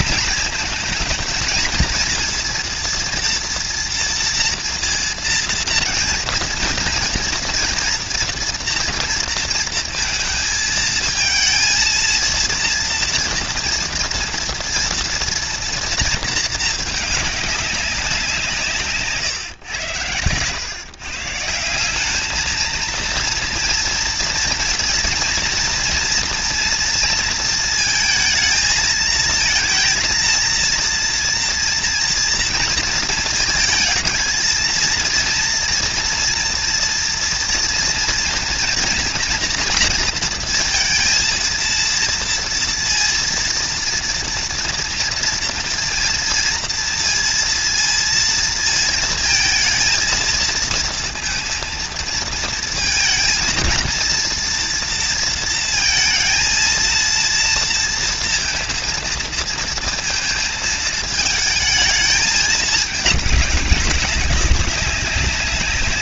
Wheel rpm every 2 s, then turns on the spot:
220, 230, 230, 240, 240, 230, 230, 230, 220, 160, 120, 220, 230, 230, 220, 230, 230, 230, 230, 240, 230, 230, 230, 230, 230, 230, 230, 230, 230, 230, 220, 220, 190.
none